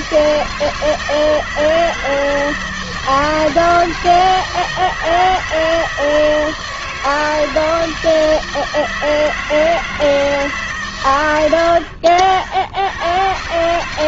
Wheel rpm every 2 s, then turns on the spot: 160, 160, 160, 160, 160, 140, 90.
none